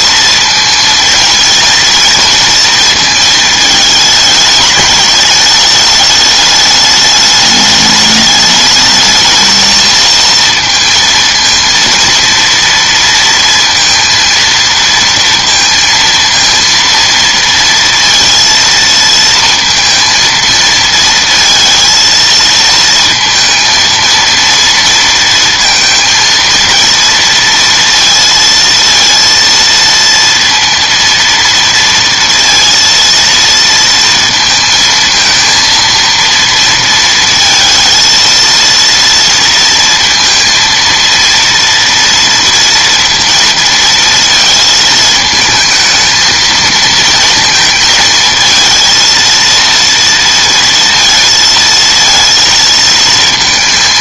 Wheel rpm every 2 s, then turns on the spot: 220, 230, 210, 210, 210, 230, 230, 230, 230, 230, 230, 230, 230, 230, 230, 230, 230, 220, 230, 230, 230, 230, 220, 230, 230, 230, 230.
none